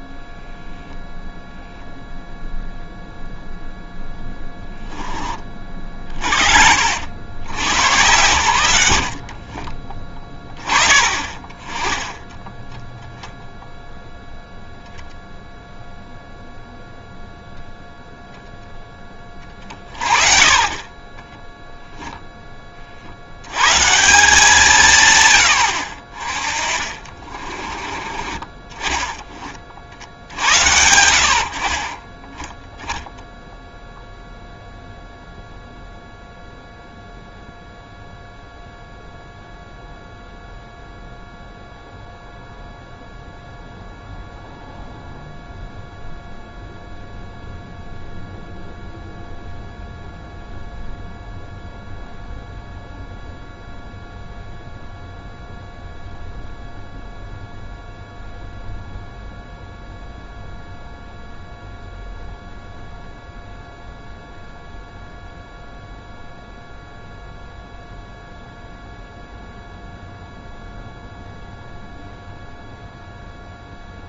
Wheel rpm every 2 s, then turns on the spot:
0, 0, 10, 50, 110, 20, 10, 0, 0, 0, 40, 20, 170, 30, 20, 80, 10, 0, 0, 0, 0, 0, 0, 0, 0, 0, 0, 0, 0, 0, 0, 0, 0, 0, 0, 0, 0.
26-28